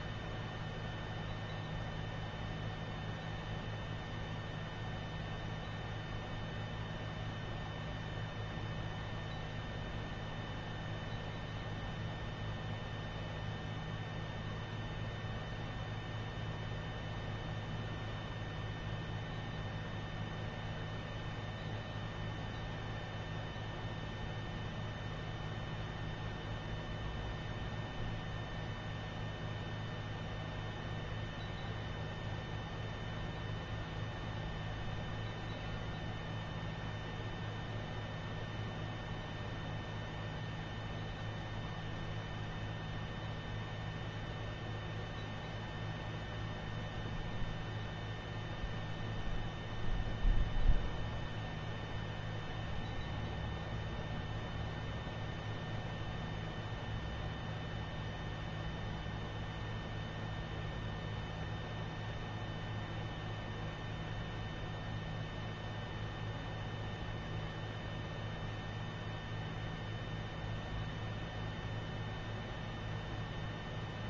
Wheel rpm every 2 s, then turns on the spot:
0, 0, 0, 0, 0, 0, 0, 0, 0, 0, 0, 0, 0, 0, 0, 0, 0, 0, 0, 0, 0, 0, 0, 0, 0, 0, 0, 0, 0, 0, 0, 0, 0, 0, 0, 0, 0.
none